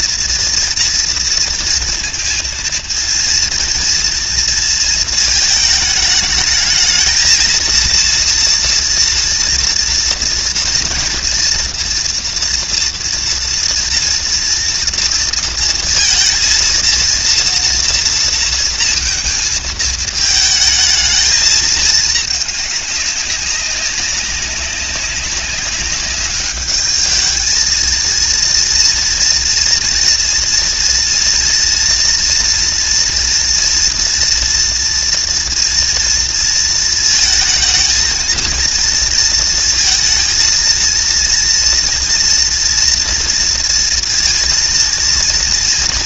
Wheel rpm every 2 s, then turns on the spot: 230, 230, 230, 220, 230, 230, 230, 240, 230, 230, 220, 210, 190, 200, 230, 230, 230, 230, 230, 220, 230, 230, 230.
none